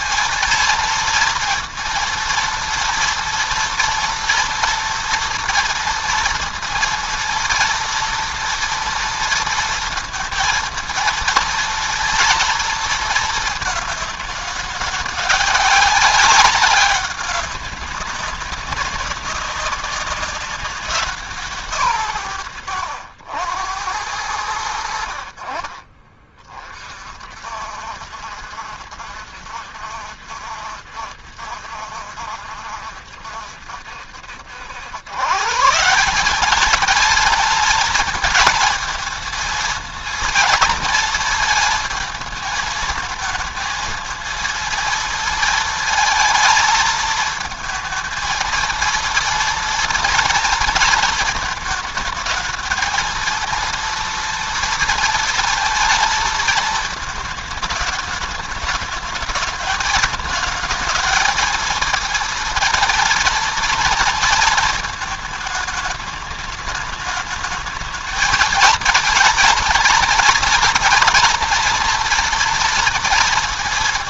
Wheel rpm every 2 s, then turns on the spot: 230, 230, 230, 230, 230, 230, 230, 200, 190, 200, 190, 110, 80, 40, 60, 70, 70, 90, 200, 220, 230, 220, 220, 220, 230, 230, 220, 230, 220, 210, 220, 230, 220, 210, 230, 230, 230.
22-24